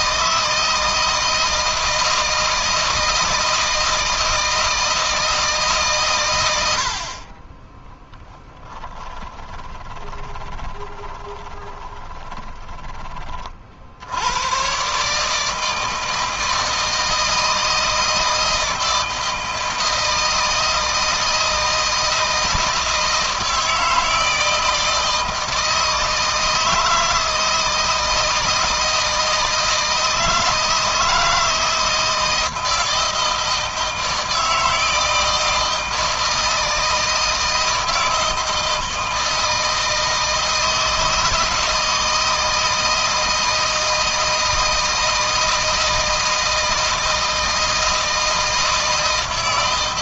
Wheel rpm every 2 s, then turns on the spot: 160, 160, 160, 60, 10, 20, 20, 130, 160, 160, 160, 160, 160, 160, 160, 160, 160, 160, 160, 160, 160, 160, 160, 160, 160.
8-12